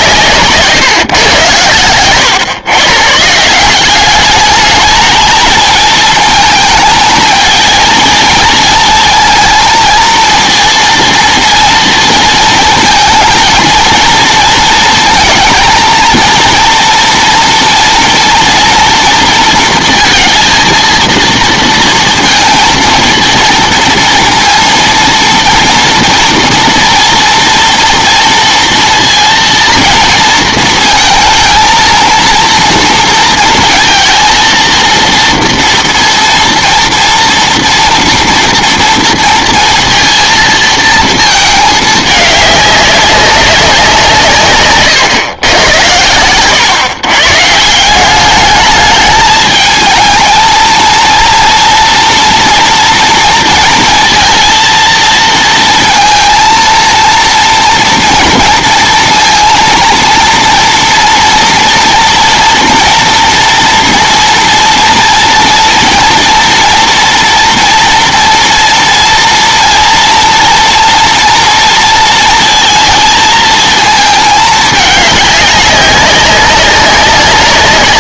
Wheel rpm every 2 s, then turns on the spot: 140, 130, 210, 220, 230, 230, 230, 220, 230, 230, 230, 220, 230, 230, 230, 220, 230, 230, 230, 230, 230, 200, 130, 140, 210, 230, 230, 230, 230, 230, 230, 240, 230, 230, 230, 230, 230, 210, 200.
none